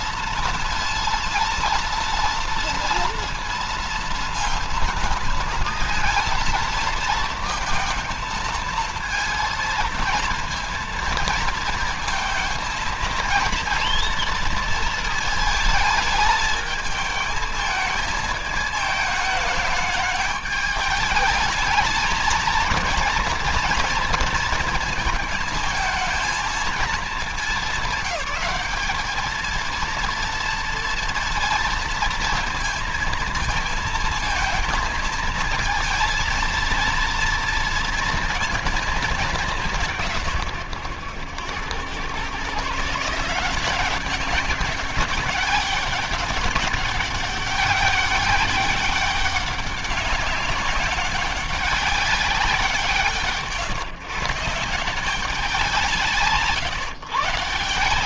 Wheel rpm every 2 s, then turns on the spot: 230, 230, 230, 230, 220, 230, 220, 230, 220, 220, 210, 230, 220, 220, 210, 230, 230, 220, 230, 220, 120, 140, 200, 200, 200, 190, 190, 180, 140.
none